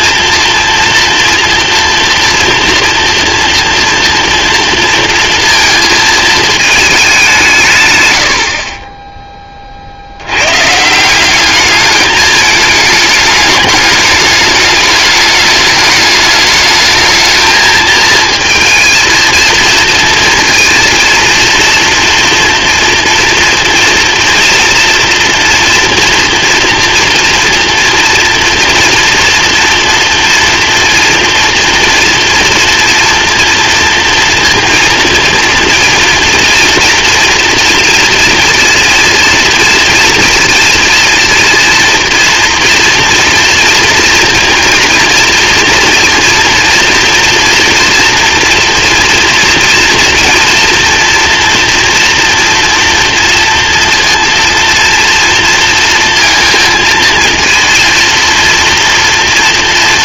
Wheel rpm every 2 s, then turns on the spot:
230, 230, 230, 220, 40, 140, 210, 210, 220, 230, 230, 230, 240, 240, 230, 230, 240, 230, 230, 230, 230, 230, 230, 230, 230, 230, 230, 230, 230, 230.
none